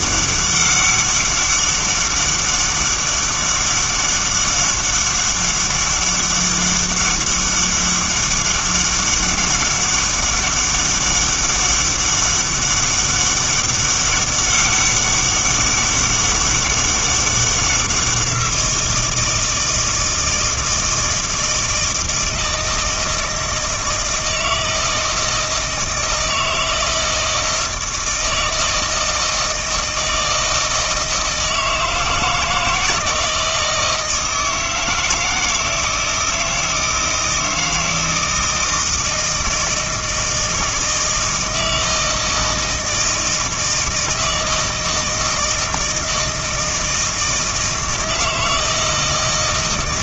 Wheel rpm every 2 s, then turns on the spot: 200, 200, 200, 200, 200, 200, 200, 200, 200, 170, 160, 160, 160, 160, 160, 160, 160, 160, 160, 160, 160, 160, 160, 160, 160.
none